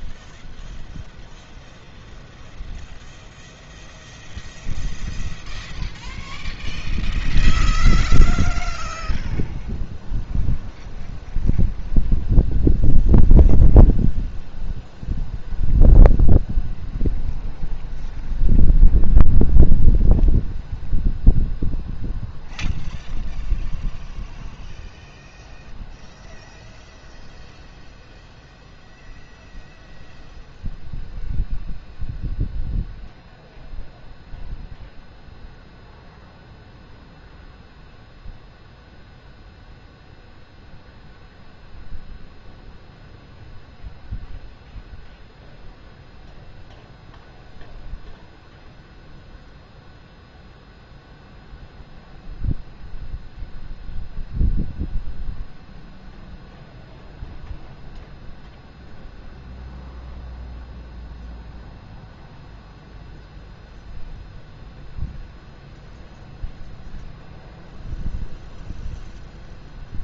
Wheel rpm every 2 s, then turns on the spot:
0, 0, 0, 0, 0, 0, 0, 0, 0, 0, 0, 0, 0, 0, 0, 0, 0, 0, 0, 0, 0, 0, 0, 0, 0, 0, 0, 0, 0, 0, 0, 0, 0, 0, 0.
none